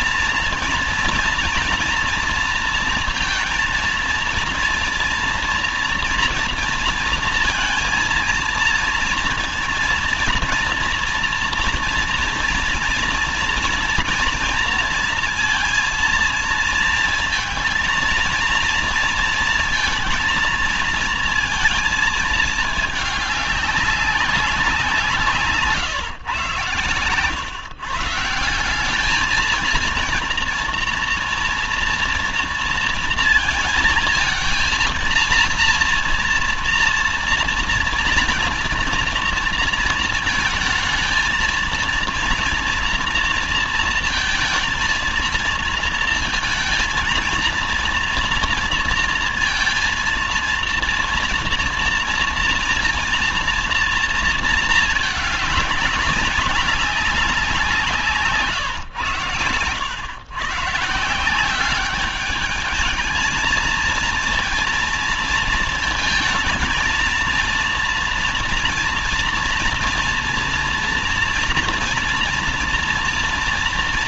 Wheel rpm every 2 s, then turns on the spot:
240, 230, 230, 230, 230, 240, 230, 230, 230, 230, 230, 220, 180, 130, 190, 230, 230, 230, 230, 240, 220, 230, 230, 230, 230, 230, 240, 220, 190, 120, 150, 210, 230, 220, 230, 230, 230.
none